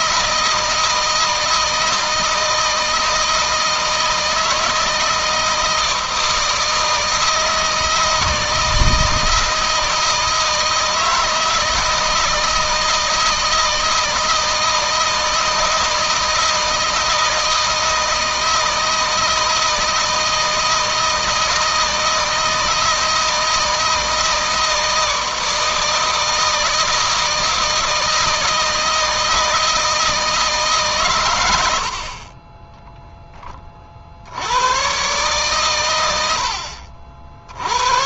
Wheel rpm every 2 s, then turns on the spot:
160, 160, 160, 160, 160, 160, 160, 160, 160, 160, 160, 160, 160, 160, 160, 140, 20, 120, 50.
none